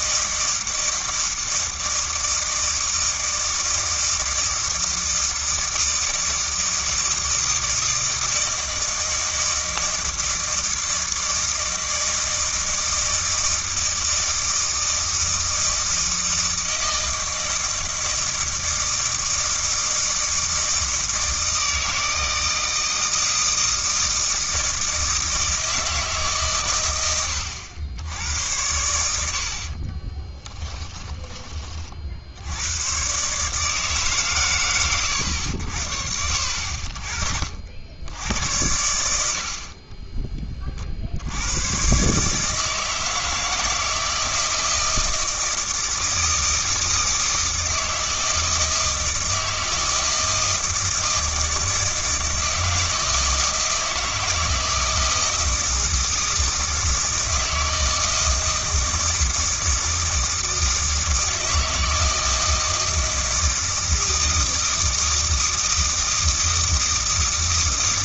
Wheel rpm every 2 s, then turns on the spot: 160, 160, 160, 160, 160, 160, 160, 160, 160, 160, 160, 160, 160, 120, 90, 10, 110, 110, 50, 90, 40, 160, 160, 160, 160, 160, 160, 160, 160, 160, 160, 160, 160, 160.
30-32